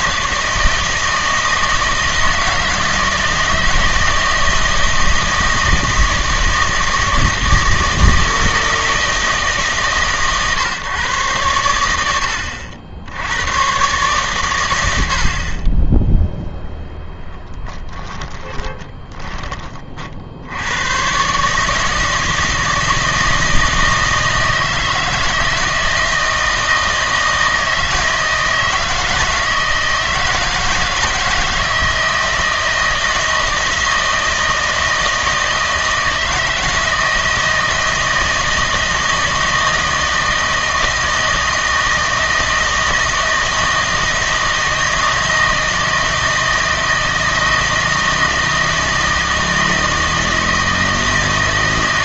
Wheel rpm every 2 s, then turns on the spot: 160, 160, 160, 160, 160, 130, 80, 90, 0, 10, 90, 160, 160, 160, 160, 160, 160, 160, 160, 160, 160, 160, 160, 160, 160, 160.
18-20